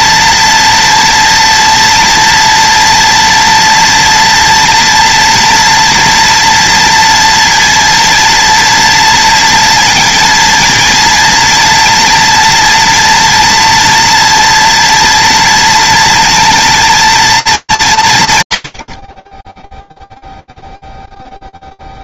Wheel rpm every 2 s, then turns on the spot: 240, 230, 240, 230, 230, 230, 230, 230, 230, 90, 0.
none